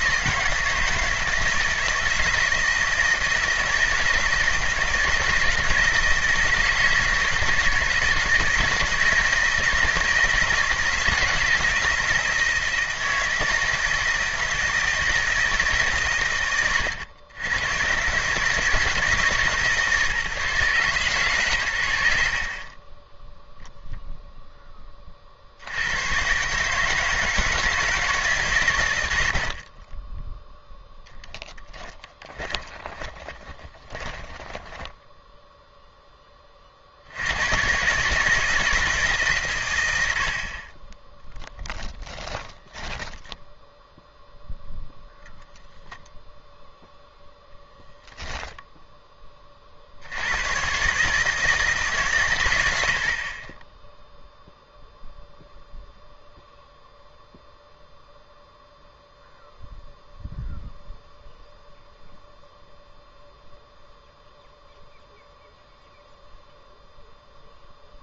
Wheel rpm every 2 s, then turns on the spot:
160, 160, 160, 160, 160, 160, 160, 160, 100, 160, 140, 20, 10, 150, 110, 10, 20, 10, 60, 160, 30, 10, 0, 0, 10, 120, 80, 0, 0, 0, 0, 0, 0, 0.
30-36 42-44